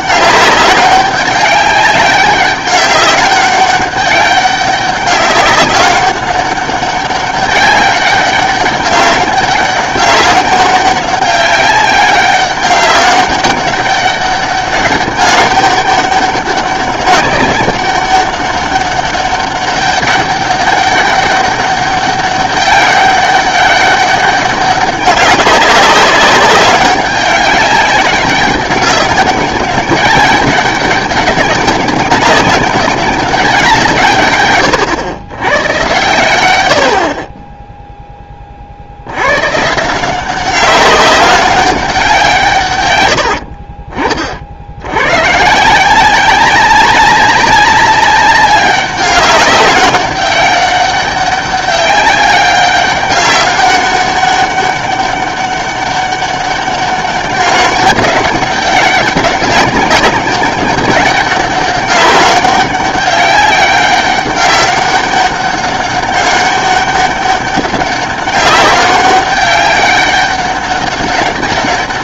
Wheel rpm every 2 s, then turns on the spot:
200, 200, 200, 200, 200, 190, 200, 200, 200, 200, 200, 200, 190, 200, 190, 200, 190, 110, 80, 40, 190, 130, 70, 190, 190, 200, 200, 200, 200, 200, 190, 190, 190, 200, 200, 200.
none